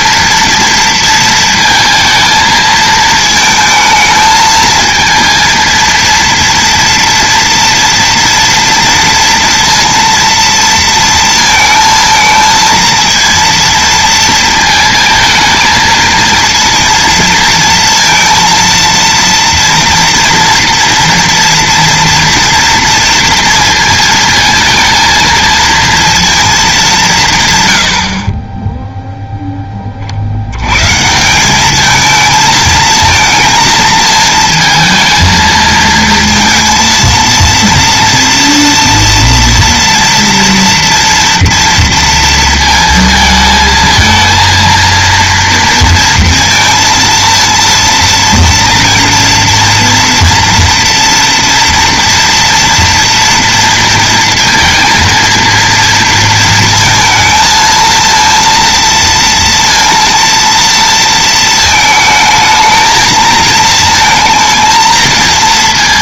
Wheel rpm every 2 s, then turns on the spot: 230, 220, 220, 230, 230, 230, 230, 230, 230, 230, 230, 230, 230, 210, 10, 120, 220, 230, 230, 230, 230, 230, 230, 230, 230, 230, 230, 230, 230, 230, 230, 220, 230.
none